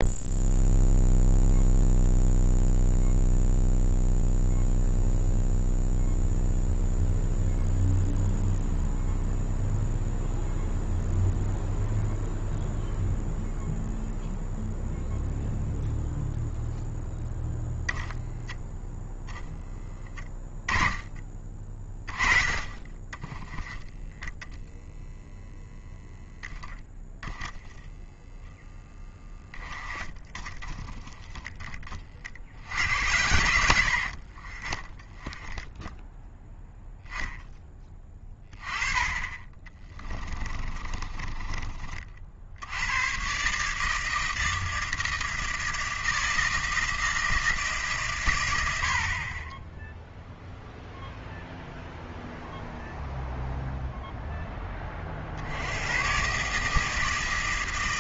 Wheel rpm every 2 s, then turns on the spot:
0, 0, 0, 0, 0, 0, 0, 0, 0, 10, 10, 30, 10, 10, 10, 10, 70, 30, 0, 20, 20, 70, 160, 160, 90, 0, 0, 20, 150.
24-32 34-36 40-42